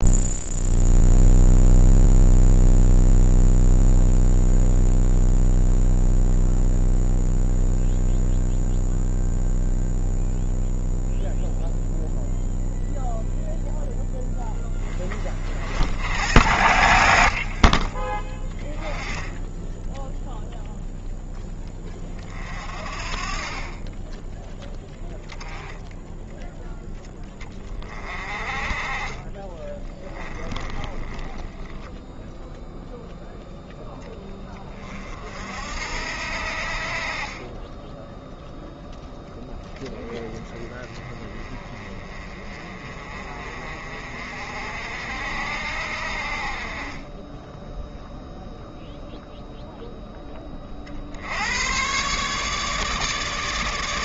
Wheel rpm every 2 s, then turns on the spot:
0, 0, 0, 0, 0, 0, 0, 20, 80, 20, 0, 40, 10, 10, 30, 20, 0, 40, 50, 10, 20, 30, 60, 30, 0, 50, 150.
30-32